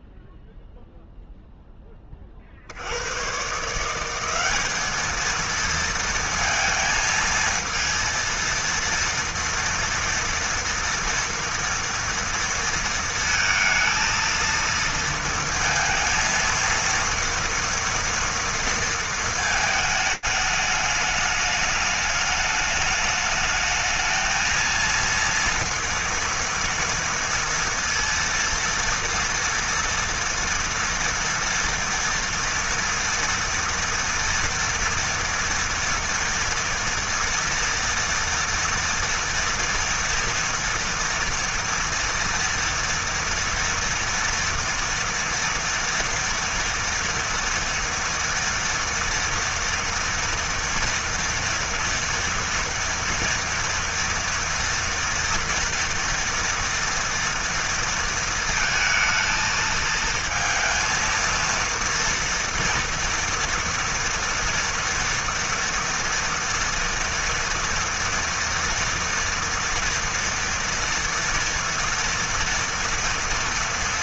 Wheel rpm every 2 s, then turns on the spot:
0, 100, 220, 230, 230, 230, 230, 230, 230, 230, 210, 210, 230, 230, 230, 230, 230, 230, 230, 230, 230, 230, 230, 230, 230, 240, 230, 230, 230, 220, 230, 230, 230, 240, 230, 230, 230.
none